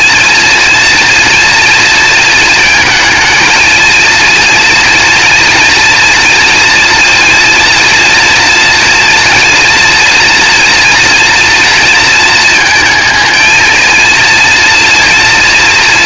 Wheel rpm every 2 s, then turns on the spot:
230, 230, 230, 230, 230, 240, 220, 230.
none